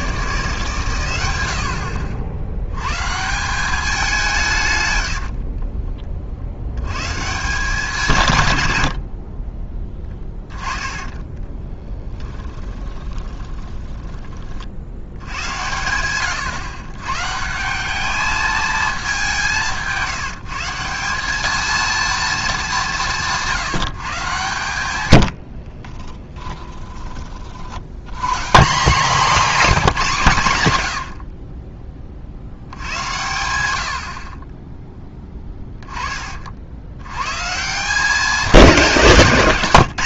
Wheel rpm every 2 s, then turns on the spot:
140, 110, 130, 90, 90, 20, 10, 70, 130, 220, 170, 200, 110, 10, 180, 100, 80, 20, 70, 200.
10-14 24-26